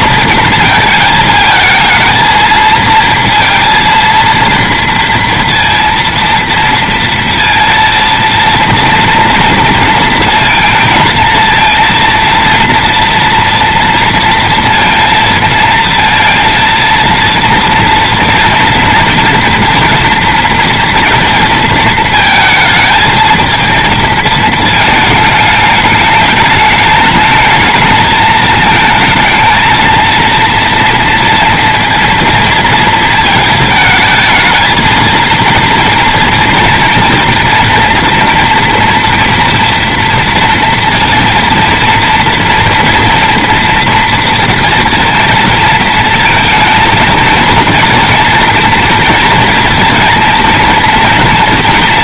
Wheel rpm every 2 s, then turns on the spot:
220, 230, 230, 230, 230, 230, 230, 230, 230, 230, 230, 220, 220, 210, 220, 230, 230, 230, 240, 240, 230, 230, 230, 230, 230, 230.
none